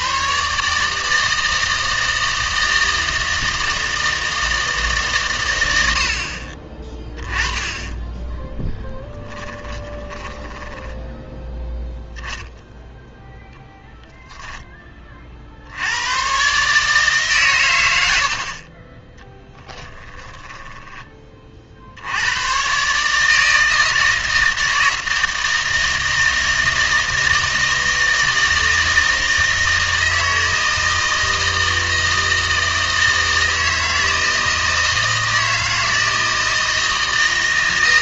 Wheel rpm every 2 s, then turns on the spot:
150, 160, 160, 30, 10, 10, 0, 20, 140, 40, 10, 130, 160, 160, 160, 160, 160, 160, 160.
8-12 20-22